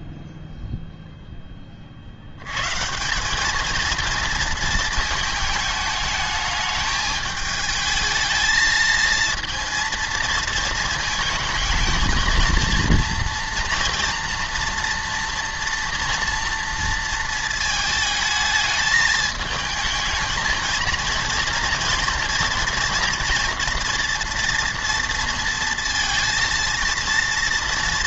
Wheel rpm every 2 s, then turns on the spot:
0, 130, 230, 210, 220, 220, 230, 230, 230, 220, 220, 230, 230, 230.
none